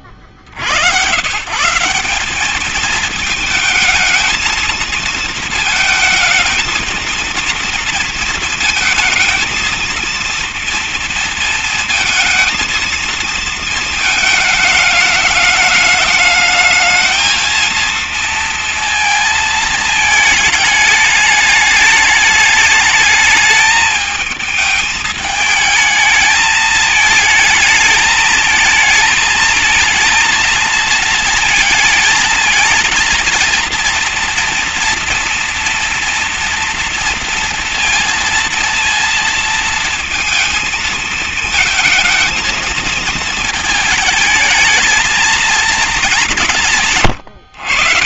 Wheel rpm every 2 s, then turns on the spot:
50, 210, 220, 230, 220, 230, 230, 210, 210, 230, 220, 210, 220, 220, 220, 230, 230, 230, 230, 230, 230, 230, 220, 150.
none